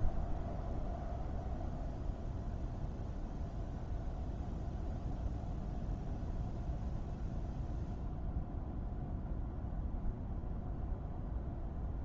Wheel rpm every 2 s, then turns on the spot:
0, 0, 0, 0, 0, 0.
none